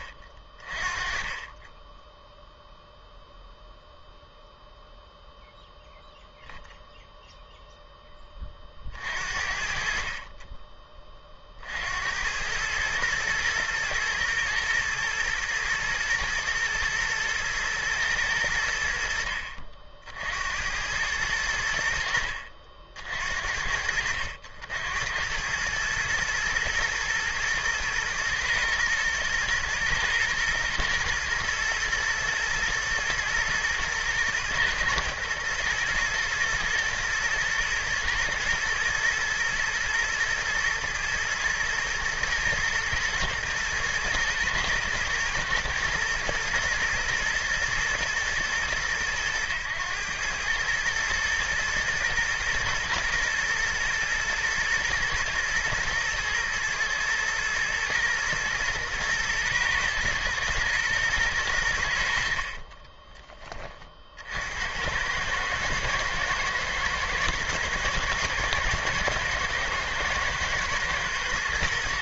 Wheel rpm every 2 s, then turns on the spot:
40, 0, 0, 0, 50, 20, 110, 110, 120, 80, 90, 60, 70, 110, 110, 110, 110, 120, 110, 110, 110, 110, 120, 120, 110, 110, 110, 110, 110, 110, 110, 30, 90, 120, 120, 110.
62-64